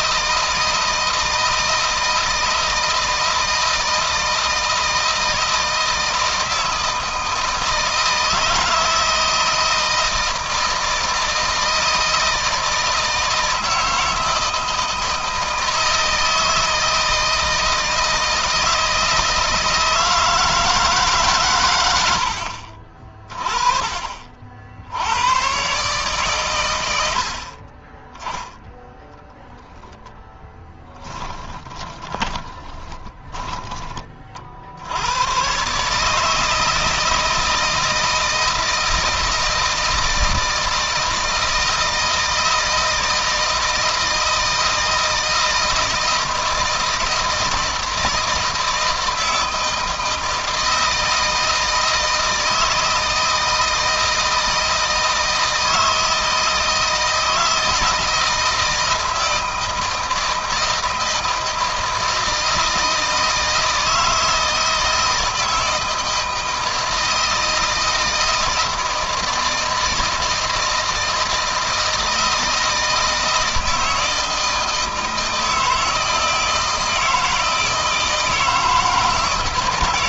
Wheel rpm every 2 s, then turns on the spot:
160, 160, 160, 160, 160, 160, 160, 160, 160, 160, 150, 30, 80, 90, 10, 10, 20, 80, 160, 160, 160, 160, 160, 160, 160, 160, 160, 160, 160, 160, 160, 160, 160, 160, 160, 160, 160, 160, 160, 160.
30-34